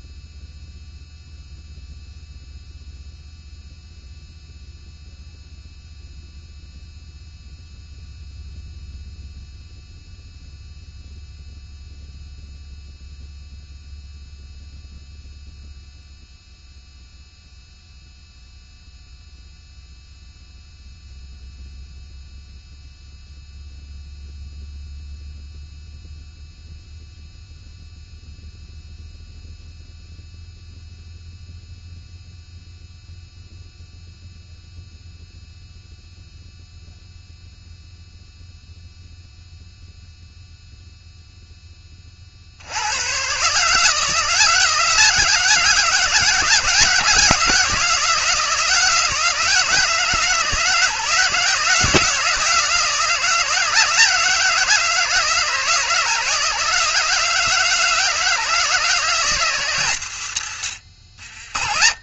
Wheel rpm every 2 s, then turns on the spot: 0, 0, 0, 0, 0, 0, 0, 0, 0, 0, 0, 0, 0, 0, 0, 0, 0, 0, 0, 0, 0, 100, 180, 190, 170, 170, 170, 160, 160, 160, 80.
none